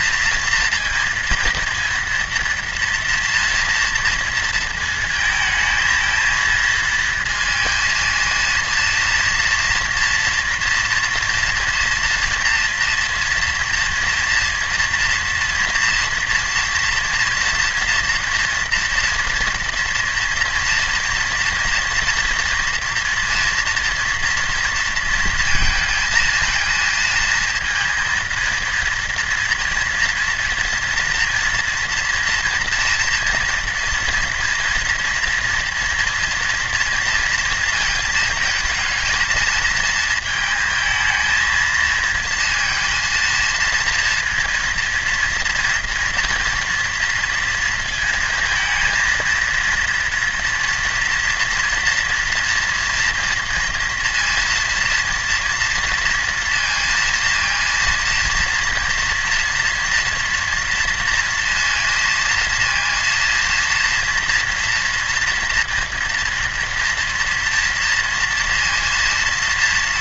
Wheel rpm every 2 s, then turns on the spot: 230, 230, 230, 230, 230, 230, 230, 230, 230, 240, 240, 240, 230, 230, 230, 230, 240, 240, 230, 230, 220, 230, 230, 230, 230, 230, 230, 230, 230, 230, 230, 230, 230, 230, 230.
none